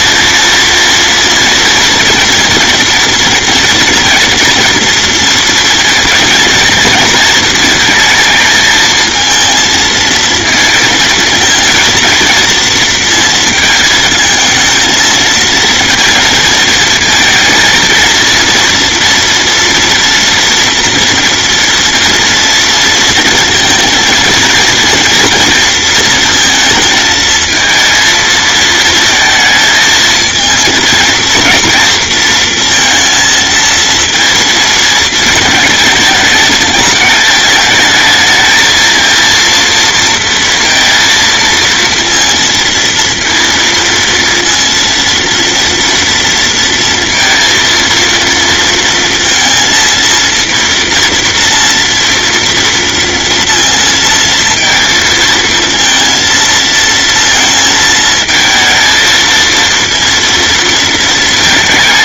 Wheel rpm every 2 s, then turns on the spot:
240, 230, 230, 230, 220, 230, 230, 220, 230, 230, 230, 230, 230, 230, 220, 230, 230, 220, 220, 230, 230, 230, 230, 230, 230, 230, 230, 230, 220, 230, 220.
none